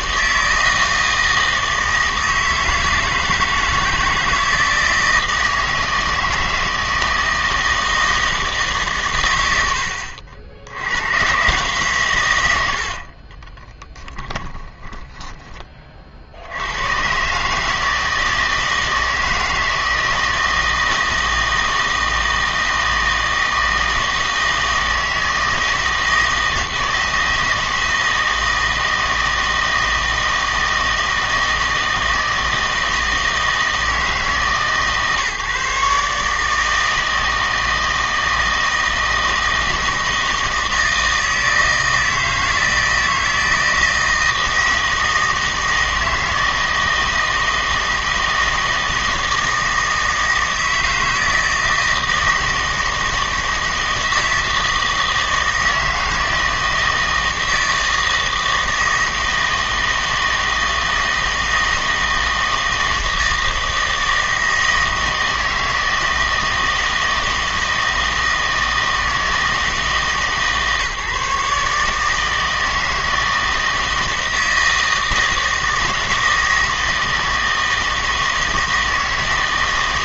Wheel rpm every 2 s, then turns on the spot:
160, 160, 160, 160, 160, 80, 110, 10, 90, 160, 160, 160, 160, 160, 160, 160, 160, 150, 150, 160, 160, 160, 160, 160, 160, 160, 160, 160, 160, 160, 160, 160, 160, 160, 160, 150, 160, 160, 160, 160.
14-16